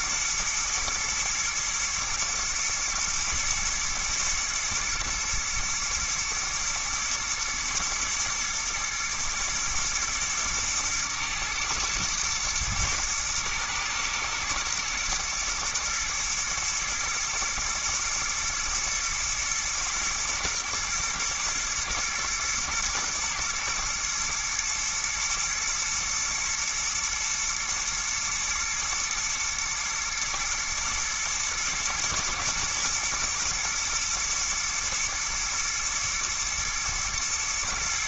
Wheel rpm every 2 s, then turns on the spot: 110, 110, 110, 110, 110, 110, 110, 110, 110, 110, 110, 120, 110, 110, 120, 120, 120, 110, 110.
none